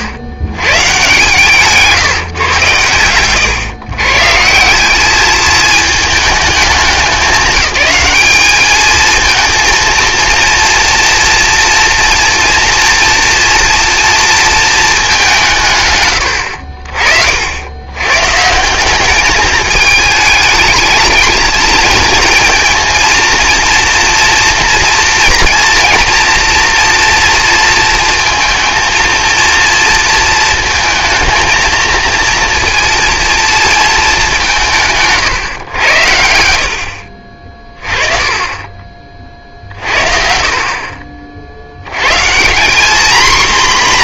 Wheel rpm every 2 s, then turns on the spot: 120, 120, 180, 200, 210, 230, 230, 220, 50, 190, 220, 230, 230, 240, 230, 230, 230, 160, 70, 30, 50, 200.
none